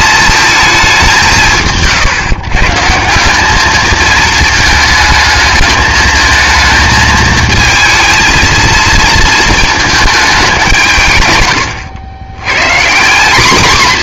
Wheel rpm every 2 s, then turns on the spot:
210, 150, 220, 220, 230, 180, 140.
none